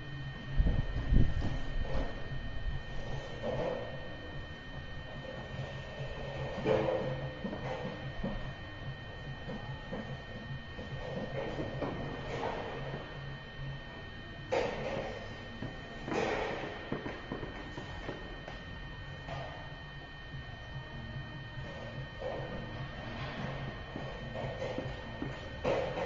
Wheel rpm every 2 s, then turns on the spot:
0, 0, 0, 0, 0, 0, 0, 0, 0, 0, 0, 0, 0.
none